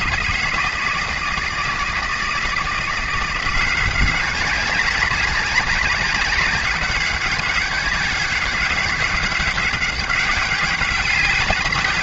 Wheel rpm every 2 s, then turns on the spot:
170, 200, 200, 200, 200, 170.
none